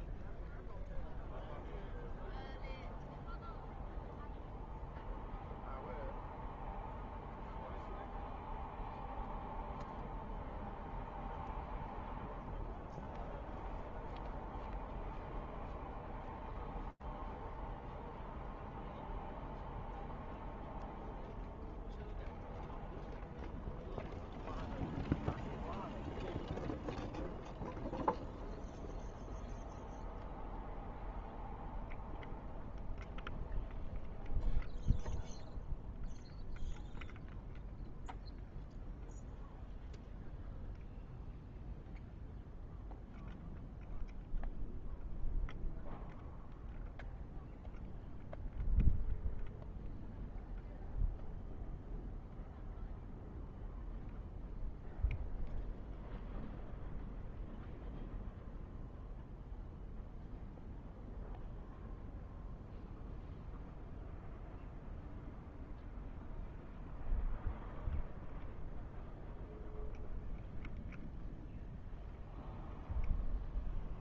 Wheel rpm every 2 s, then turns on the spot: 0, 0, 0, 0, 0, 0, 0, 0, 0, 0, 0, 0, 0, 0, 0, 0, 0, 0, 0, 0, 0, 0, 0, 0, 0, 0, 0, 0, 0, 0, 0, 0, 0, 0, 0, 0, 0.
none